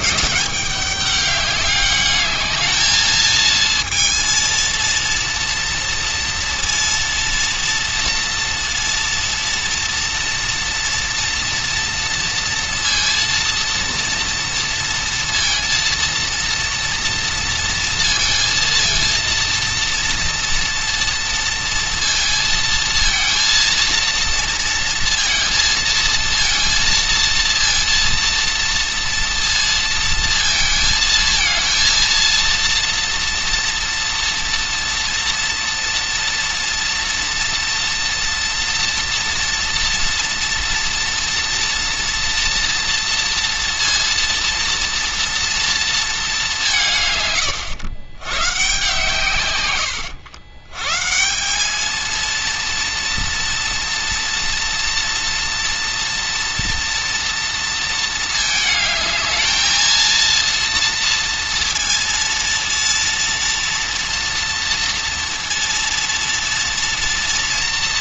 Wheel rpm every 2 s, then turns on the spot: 200, 220, 230, 230, 230, 230, 230, 230, 230, 230, 230, 230, 230, 230, 230, 220, 230, 230, 240, 230, 230, 230, 230, 160, 130, 130, 230, 230, 240, 220, 230, 230, 230, 230.
none